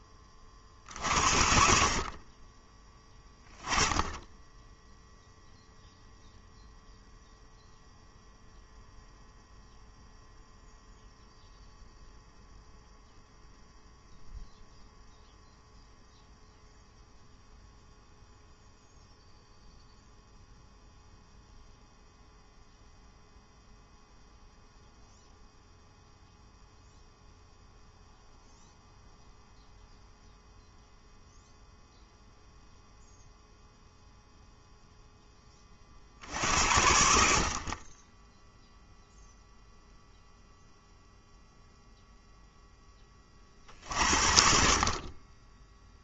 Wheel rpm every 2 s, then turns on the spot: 50, 20, 0, 0, 0, 0, 0, 0, 0, 0, 0, 0, 0, 0, 0, 0, 0, 0, 60, 0, 0, 20, 40.
none